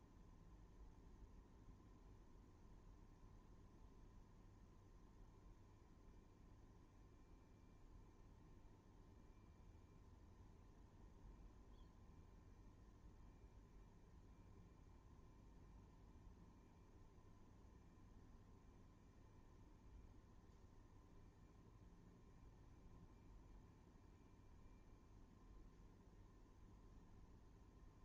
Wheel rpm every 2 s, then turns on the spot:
0, 0, 0, 0, 0, 0, 0, 0, 0, 0, 0, 0, 0, 0.
none